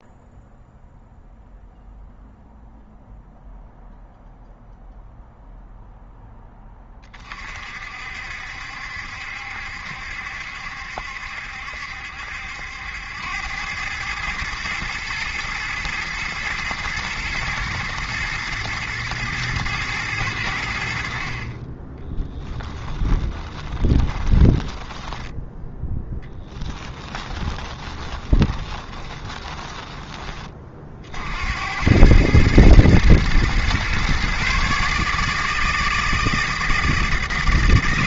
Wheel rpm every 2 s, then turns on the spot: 0, 0, 0, 20, 70, 70, 80, 110, 110, 110, 90, 10, 10, 10, 20, 40, 110, 140, 160.
22-30